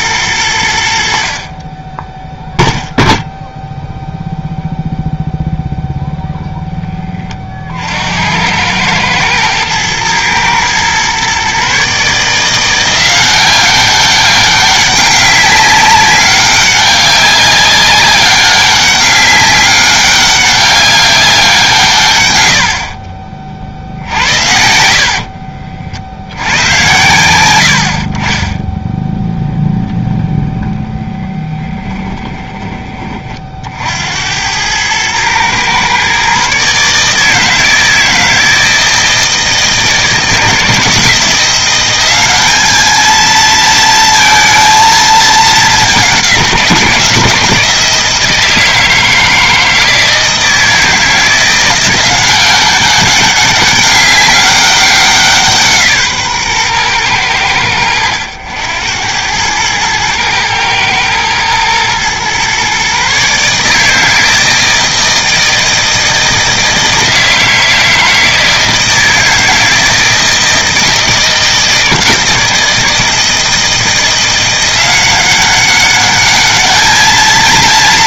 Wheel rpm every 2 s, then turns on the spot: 70, 0, 0, 10, 110, 120, 180, 200, 200, 200, 200, 40, 70, 110, 0, 0, 20, 110, 150, 160, 160, 210, 220, 170, 160, 160, 190, 190, 110, 90, 110, 140, 160, 160, 160, 160, 160, 180, 220.
24-26